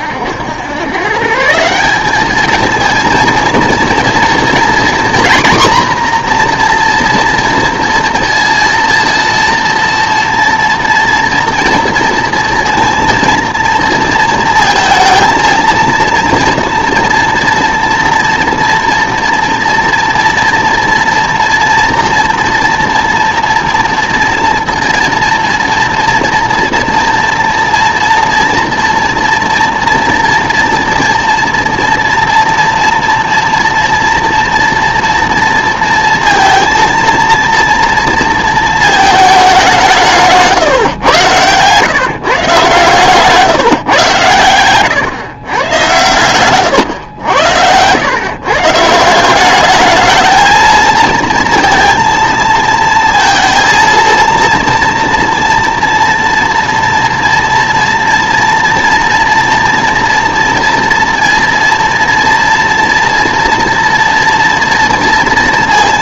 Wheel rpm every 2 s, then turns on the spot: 100, 220, 240, 240, 230, 230, 230, 230, 230, 230, 230, 230, 230, 230, 230, 230, 230, 230, 230, 230, 140, 140, 120, 120, 150, 230, 230, 230, 230, 230, 230, 230, 230.
40-42